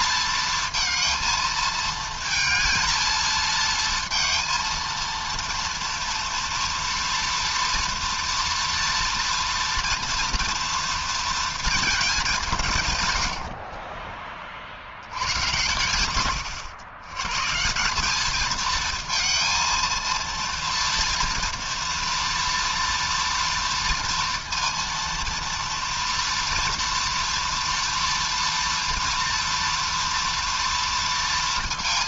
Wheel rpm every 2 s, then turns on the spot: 220, 220, 230, 230, 230, 230, 180, 30, 120, 220, 230, 230, 230, 230, 230, 230.
none